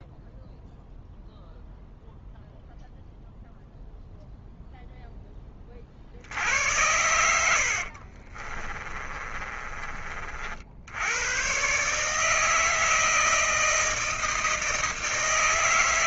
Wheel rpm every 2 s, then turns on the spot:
0, 0, 0, 80, 40, 60, 160, 160.
6-10